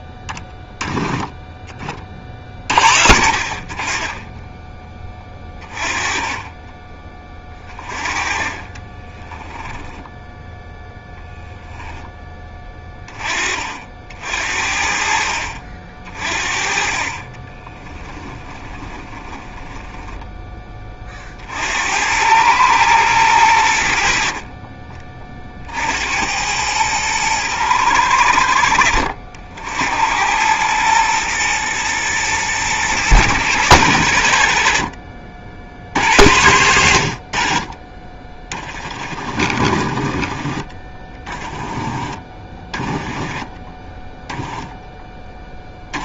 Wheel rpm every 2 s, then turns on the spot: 10, 50, 10, 20, 20, 0, 20, 60, 40, 20, 20, 110, 40, 100, 80, 110, 110, 60, 80, 30, 20, 20, 10.
0-2 8-10 18-20 38-40 42-44